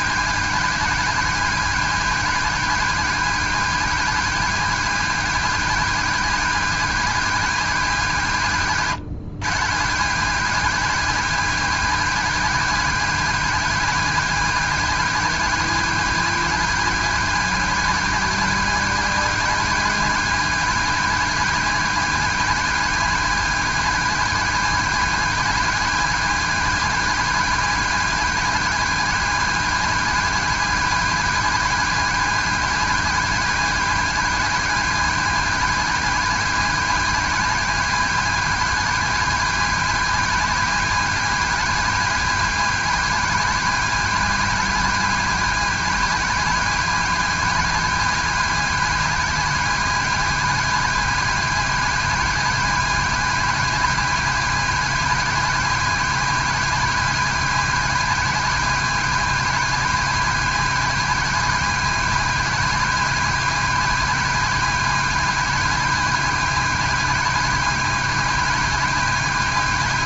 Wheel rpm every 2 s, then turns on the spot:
180, 180, 180, 180, 130, 170, 170, 180, 180, 180, 180, 180, 180, 180, 180, 180, 180, 180, 180, 180, 180, 180, 180, 180, 180, 180, 180, 170, 180, 170, 170, 180, 180, 180, 180.
none